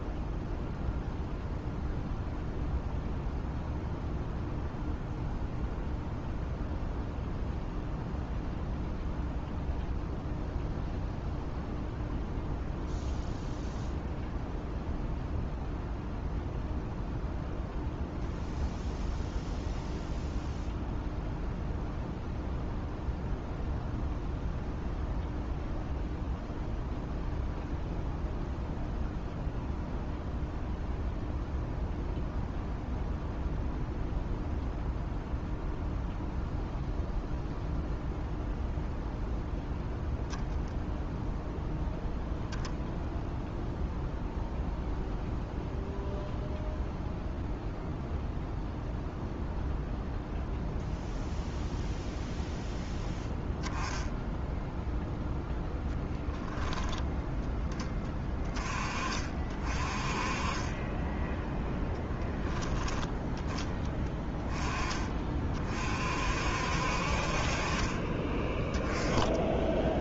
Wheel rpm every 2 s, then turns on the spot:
0, 0, 0, 0, 0, 0, 0, 0, 0, 0, 0, 0, 0, 0, 0, 0, 0, 0, 0, 0, 0, 0, 0, 0, 0, 0, 0, 0, 0, 30, 0, 10, 20, 50, 10.
none